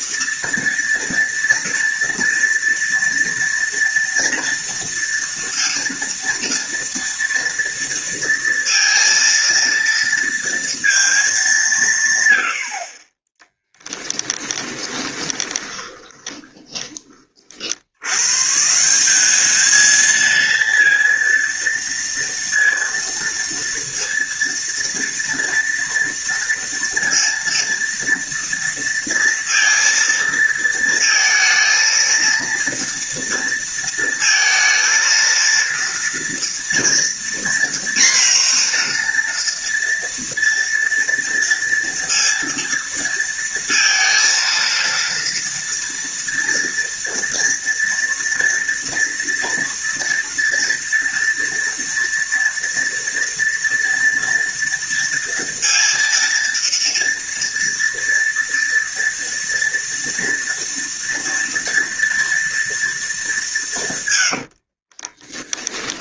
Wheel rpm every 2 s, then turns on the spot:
230, 230, 230, 230, 230, 230, 90, 20, 20, 130, 230, 230, 230, 230, 230, 230, 230, 230, 230, 240, 230, 230, 230, 230, 230, 230, 230, 240, 230, 230, 230, 230, 90.
14-18 64-66